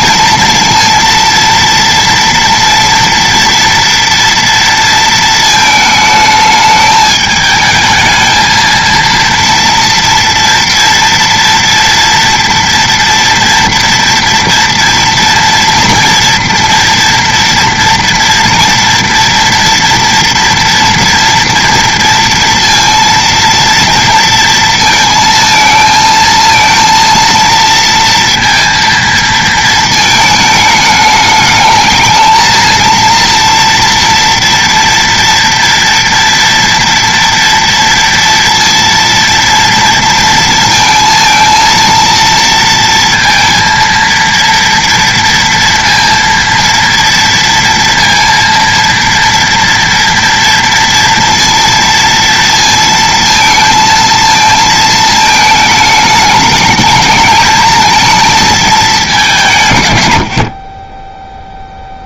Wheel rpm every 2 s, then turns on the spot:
230, 240, 230, 210, 230, 230, 230, 230, 240, 230, 230, 230, 230, 230, 230, 210, 230, 230, 230, 230, 220, 230, 230, 230, 230, 230, 220, 220, 220, 220, 30.
none